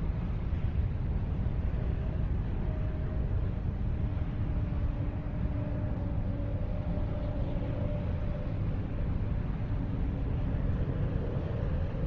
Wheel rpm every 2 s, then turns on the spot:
0, 0, 0, 0, 0, 0.
none